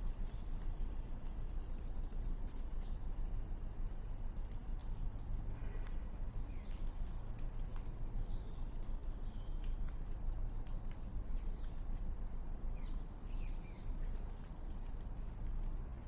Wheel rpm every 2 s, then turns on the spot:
0, 0, 0, 0, 0, 0, 0, 0.
none